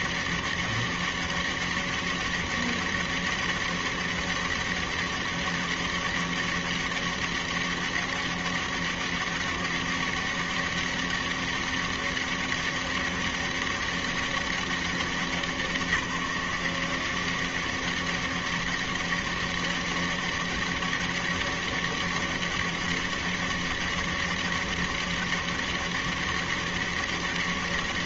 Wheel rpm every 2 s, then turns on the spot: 200, 200, 200, 200, 200, 200, 200, 200, 180, 200, 200, 200, 200, 200.
none